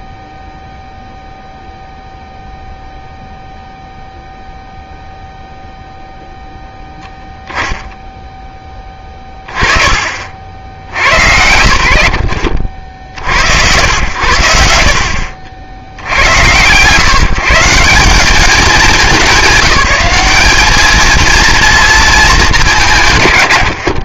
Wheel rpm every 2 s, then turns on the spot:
0, 0, 0, 0, 10, 80, 50, 60, 130, 190, 210, 190.
none